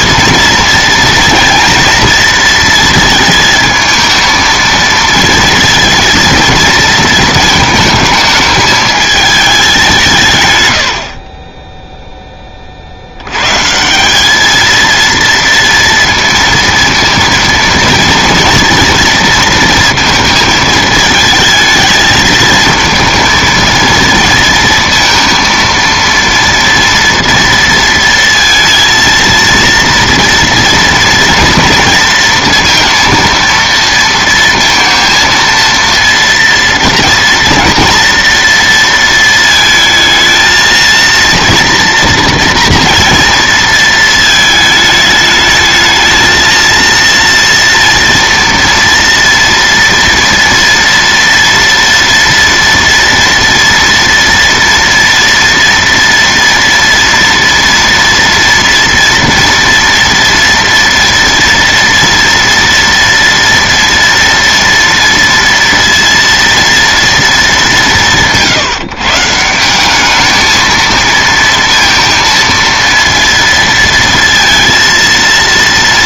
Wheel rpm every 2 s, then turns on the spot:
230, 230, 230, 230, 220, 100, 30, 220, 230, 230, 230, 220, 230, 230, 230, 230, 230, 230, 230, 230, 220, 230, 220, 230, 230, 230, 230, 230, 230, 230, 230, 230, 230, 230, 160, 220, 230, 230.
none